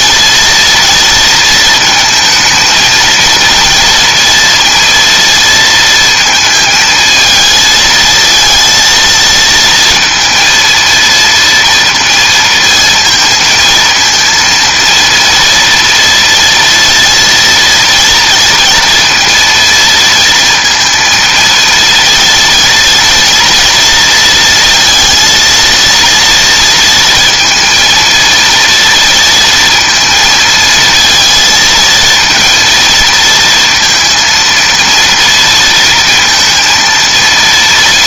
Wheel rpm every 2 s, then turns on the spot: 230, 230, 230, 230, 230, 230, 230, 230, 230, 230, 230, 230, 230, 230, 230, 230, 230, 230, 230.
none